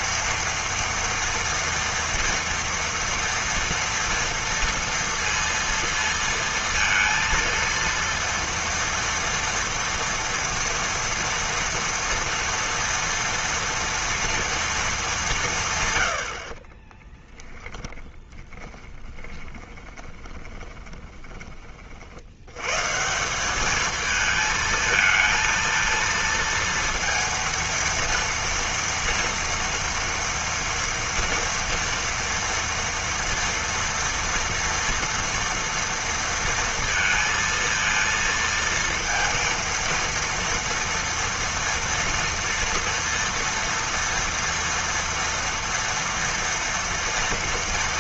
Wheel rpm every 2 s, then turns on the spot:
230, 230, 230, 230, 230, 230, 240, 230, 60, 20, 20, 110, 220, 230, 230, 230, 230, 230, 230, 230, 230, 230, 230, 230.
18-22